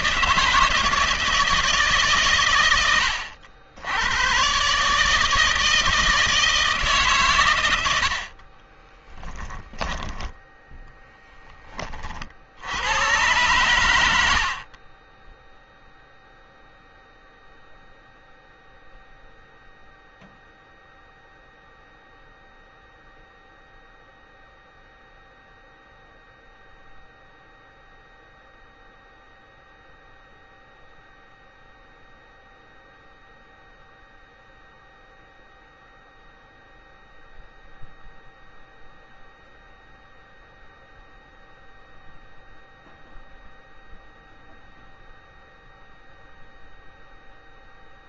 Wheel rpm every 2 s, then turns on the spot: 160, 130, 110, 160, 50, 10, 50, 90, 0, 0, 0, 0, 0, 0, 0, 0, 0, 0, 0, 0, 0, 0, 0, 0.
8-10